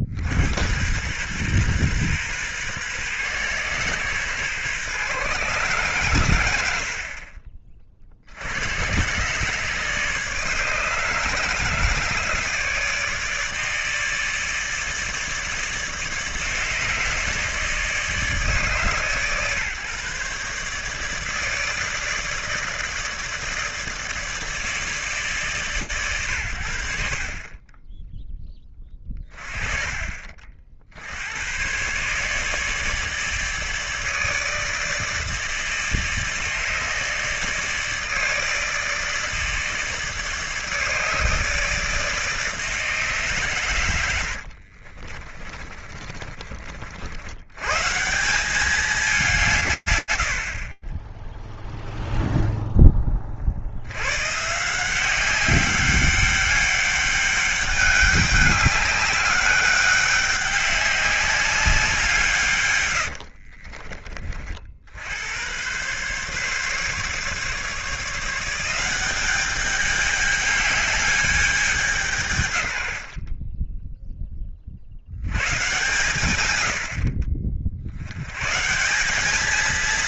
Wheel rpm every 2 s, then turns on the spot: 80, 120, 130, 100, 70, 150, 160, 150, 150, 150, 140, 150, 160, 110, 10, 40, 140, 150, 150, 150, 160, 150, 60, 40, 190, 20, 10, 160, 200, 200, 200, 110, 70, 140, 180, 210, 80, 60, 70, 170.
44-46 50-52